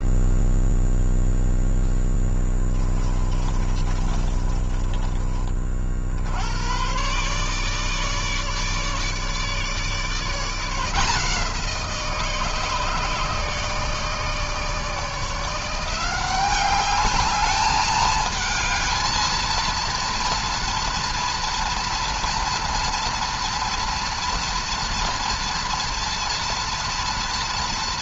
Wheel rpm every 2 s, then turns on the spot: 0, 20, 30, 110, 150, 160, 150, 160, 200, 220, 230, 230, 230, 230.
2-6